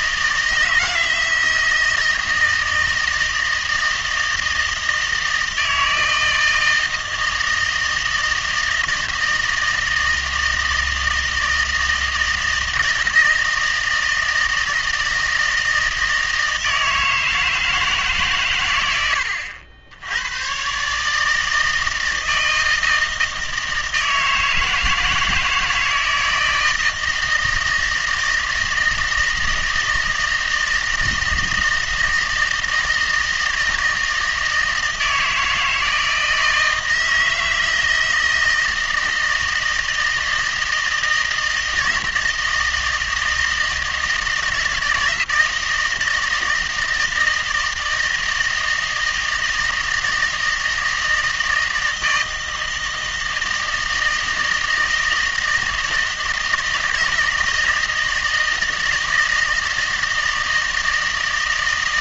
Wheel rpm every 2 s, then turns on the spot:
160, 160, 160, 160, 160, 160, 160, 160, 160, 120, 120, 160, 160, 160, 160, 160, 160, 160, 160, 160, 160, 170, 160, 160, 160, 160, 160, 160, 160, 160, 160.
none